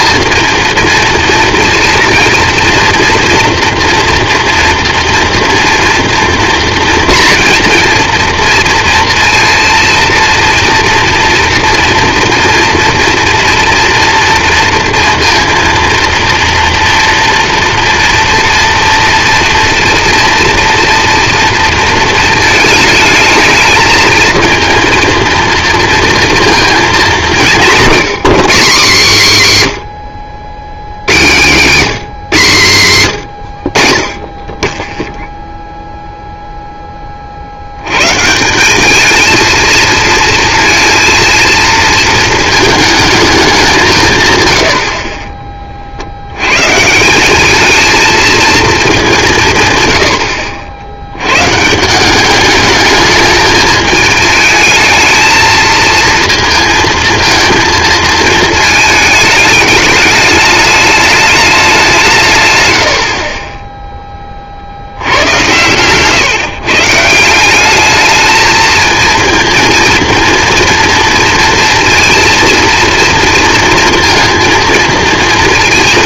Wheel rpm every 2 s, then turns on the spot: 230, 230, 230, 230, 230, 230, 230, 230, 230, 230, 230, 220, 230, 230, 200, 90, 140, 20, 0, 180, 230, 220, 110, 100, 230, 70, 200, 220, 230, 220, 210, 140, 50, 150, 220, 230, 230, 230.
none